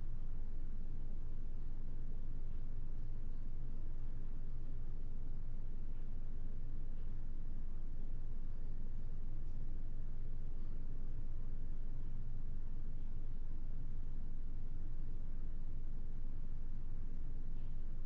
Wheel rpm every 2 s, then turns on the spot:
0, 0, 0, 0, 0, 0, 0, 0, 0.
none